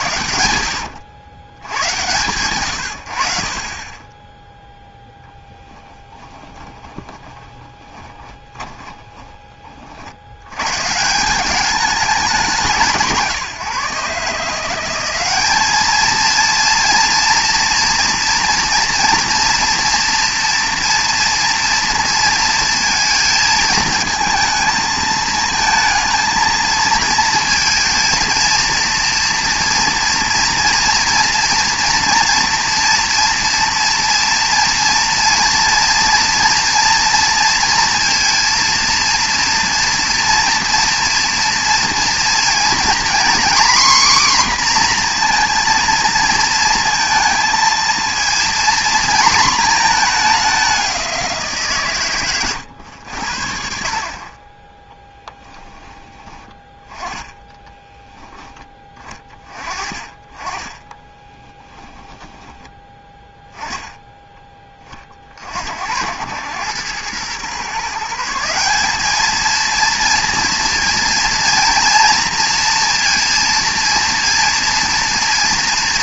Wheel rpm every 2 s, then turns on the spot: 80, 110, 0, 20, 20, 120, 180, 180, 230, 230, 230, 230, 220, 220, 230, 240, 230, 230, 240, 230, 230, 240, 250, 230, 230, 200, 100, 20, 20, 20, 20, 10, 20, 100, 190, 230, 230, 230.
6-10